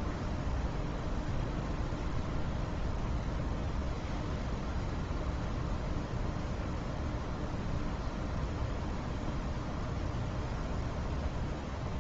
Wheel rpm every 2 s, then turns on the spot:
0, 0, 0, 0, 0, 0.
none